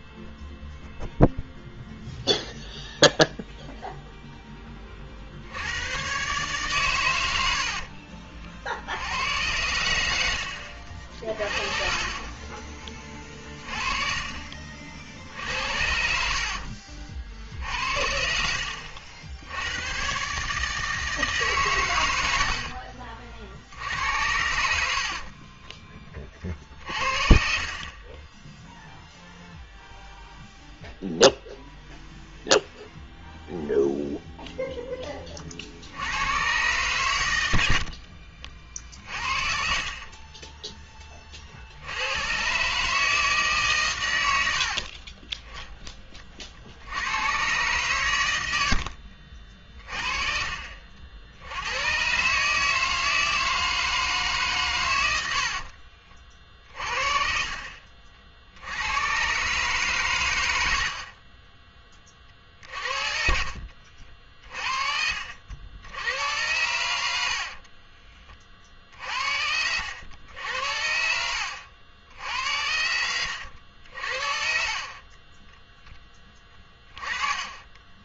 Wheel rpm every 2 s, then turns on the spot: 0, 0, 10, 130, 40, 80, 20, 40, 60, 60, 140, 80, 70, 40, 10, 0, 0, 0, 120, 50, 20, 120, 80, 50, 90, 40, 150, 140, 40, 70, 90, 40, 40, 90, 40, 90, 80, 40, 20.
12-14 16-18 48-50 62-64 76-78